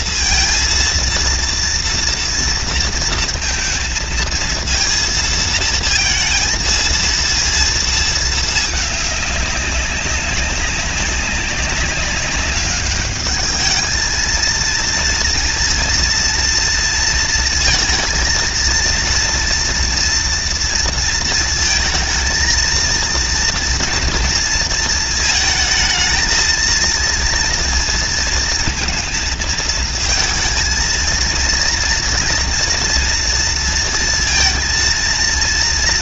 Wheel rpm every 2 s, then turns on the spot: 230, 230, 230, 230, 200, 200, 210, 230, 230, 230, 230, 230, 220, 230, 230, 230, 230, 230.
none